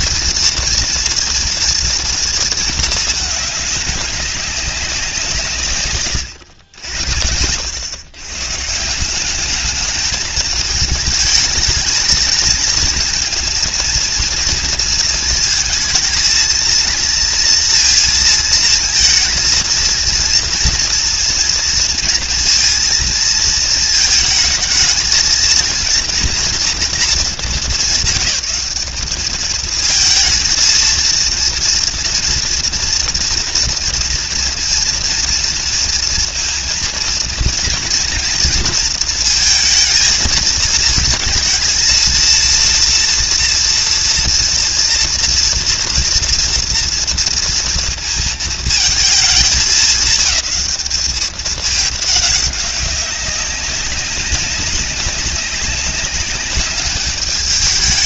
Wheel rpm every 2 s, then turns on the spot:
230, 220, 190, 80, 170, 210, 230, 230, 220, 230, 230, 230, 220, 240, 200, 230, 230, 230, 230, 230, 230, 240, 230, 230, 220, 210, 190, 200, 200.
none